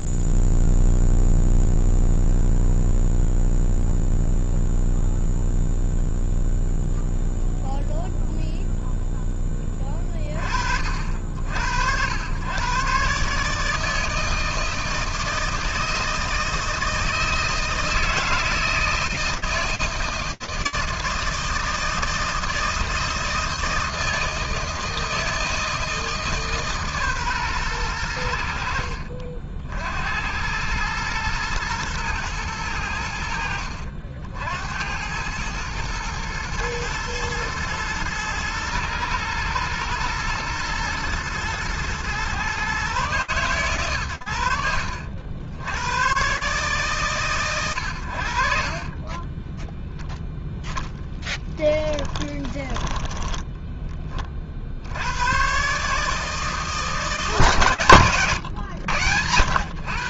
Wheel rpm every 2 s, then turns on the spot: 0, 0, 0, 0, 0, 20, 80, 150, 160, 160, 160, 160, 160, 150, 80, 90, 100, 80, 120, 110, 110, 130, 80, 130, 20, 10, 10, 90, 160, 100.
48-54